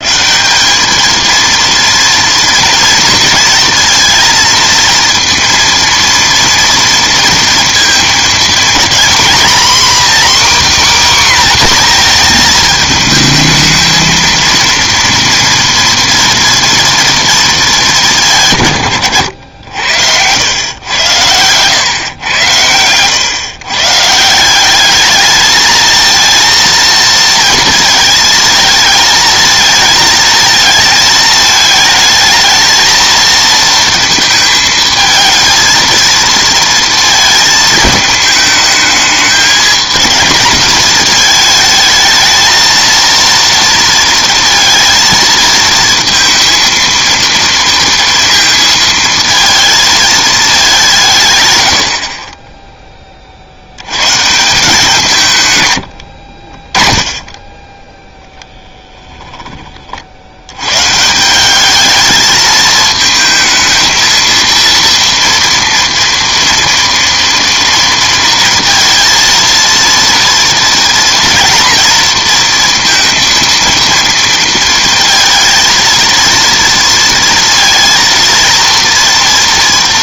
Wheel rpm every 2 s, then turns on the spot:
190, 230, 230, 230, 230, 280, 220, 230, 240, 120, 100, 110, 200, 230, 220, 220, 220, 220, 230, 220, 220, 230, 230, 230, 230, 190, 10, 170, 20, 0, 120, 220, 230, 230, 230, 230, 230, 230, 230, 230.
none